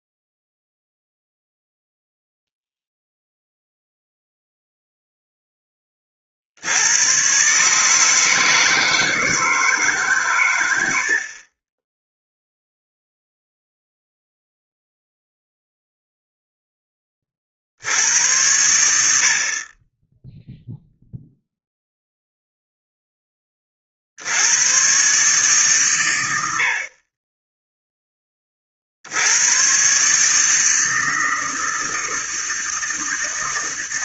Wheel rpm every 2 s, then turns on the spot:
0, 0, 0, 60, 150, 110, 0, 0, 10, 90, 0, 0, 120, 40, 70, 160, 160.
none